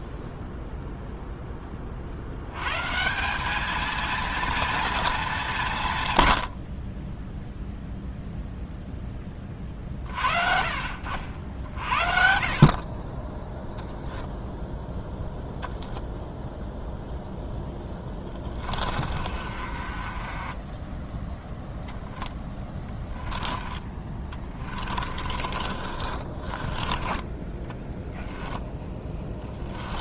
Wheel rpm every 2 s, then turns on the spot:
0, 130, 230, 50, 0, 60, 50, 0, 0, 30, 20, 10, 30, 20, 10.
18-20 22-30